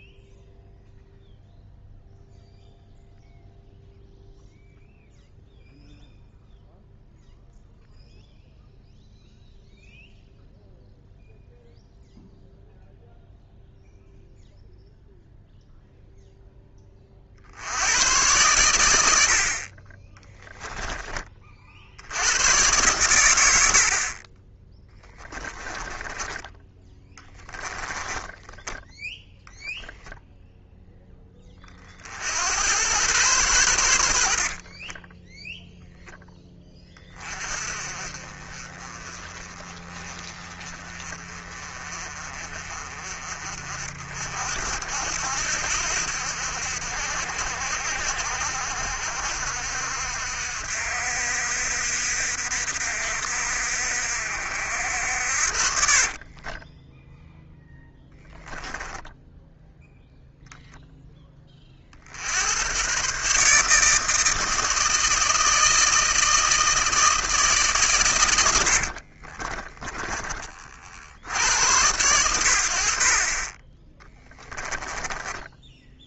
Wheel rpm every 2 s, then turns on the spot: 0, 0, 0, 0, 0, 0, 0, 0, 20, 100, 20, 120, 20, 10, 10, 0, 100, 40, 20, 30, 30, 40, 60, 70, 60, 60, 60, 70, 20, 10, 10, 110, 160, 160, 80, 60, 60, 10.
24-26 34-36 56-58 68-70 74-76